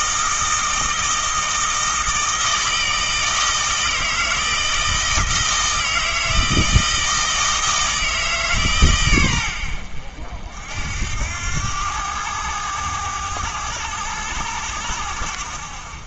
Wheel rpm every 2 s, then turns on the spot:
160, 160, 160, 160, 130, 60, 100, 90.
none